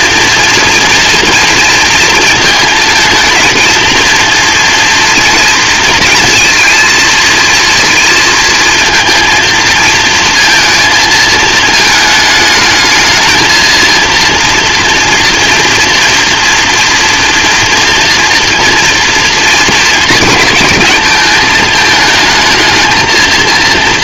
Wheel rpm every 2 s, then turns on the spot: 230, 220, 230, 230, 230, 230, 220, 240, 230, 230, 210, 220.
none